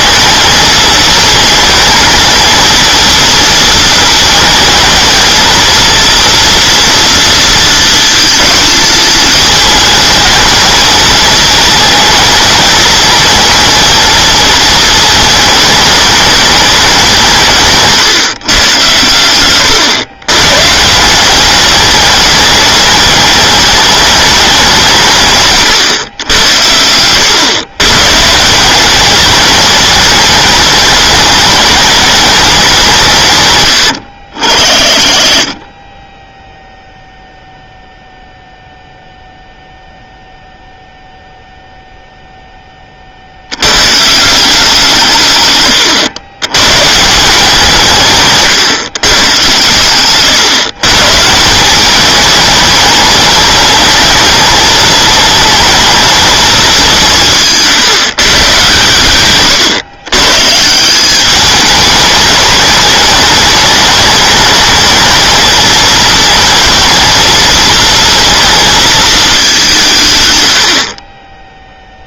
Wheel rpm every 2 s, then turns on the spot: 220, 230, 220, 230, 220, 220, 220, 220, 200, 120, 150, 210, 190, 90, 180, 210, 190, 50, 0, 0, 0, 20, 180, 120, 140, 130, 210, 220, 200, 130, 160, 210, 220, 220, 230, 60.
none